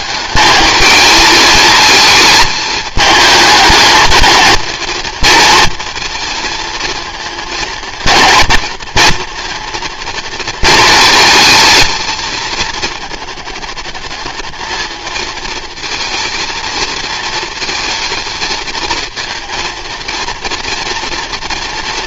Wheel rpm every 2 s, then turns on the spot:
220, 210, 220, 230, 230, 220, 220, 220, 230, 220, 230.
none